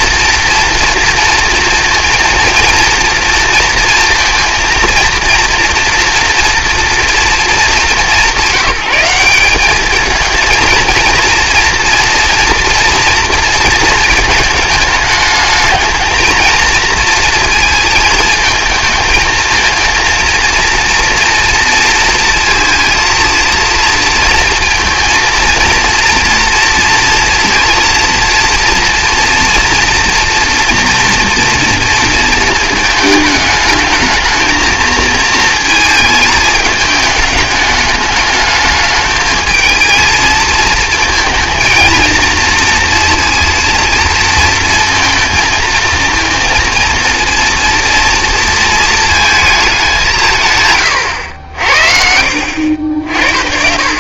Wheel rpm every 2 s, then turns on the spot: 230, 230, 230, 230, 170, 230, 240, 210, 230, 220, 230, 230, 230, 230, 230, 230, 220, 230, 210, 220, 220, 230, 220, 230, 230, 140, 60.
none